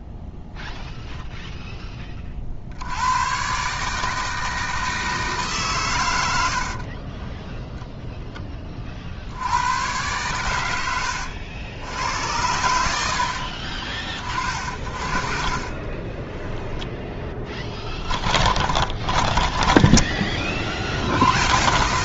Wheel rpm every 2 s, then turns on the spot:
0, 50, 160, 70, 10, 100, 90, 40, 10, 30, 40.
6-8 14-20